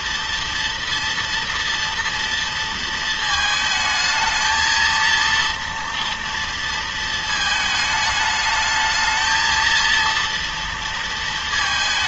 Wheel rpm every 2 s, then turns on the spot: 230, 230, 230, 230, 220, 230.
none